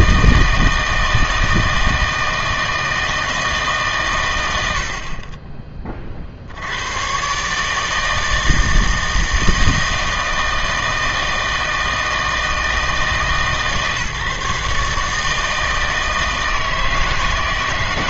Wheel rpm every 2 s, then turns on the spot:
160, 160, 80, 80, 160, 160, 160, 140, 160.
none